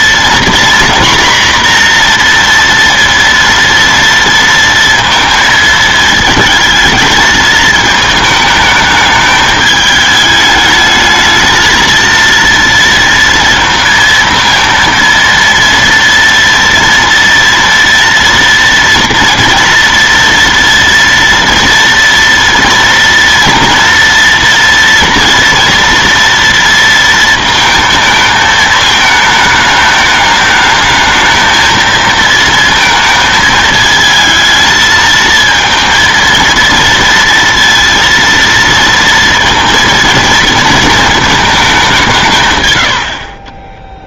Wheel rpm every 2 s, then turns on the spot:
240, 230, 230, 220, 210, 220, 230, 230, 230, 230, 230, 230, 230, 230, 220, 220, 220, 220, 230, 230, 220, 70.
none